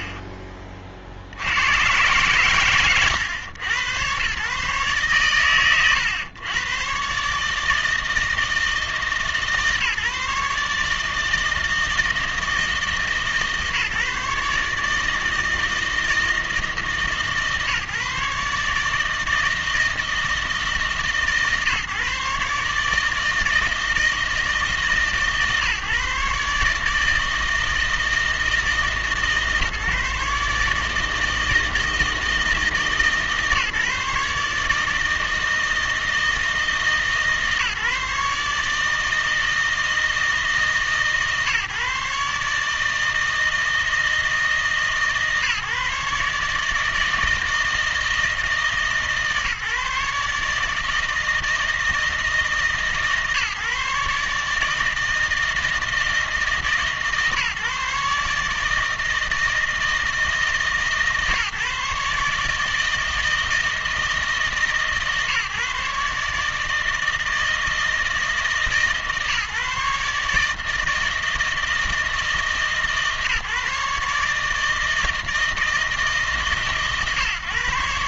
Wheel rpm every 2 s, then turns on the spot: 40, 110, 130, 110, 160, 150, 160, 150, 150, 150, 150, 150, 150, 150, 160, 150, 160, 150, 160, 150, 150, 150, 160, 150, 160, 150, 160, 160, 150, 160, 160, 160, 160, 160, 160, 150, 150, 160, 140.
0-2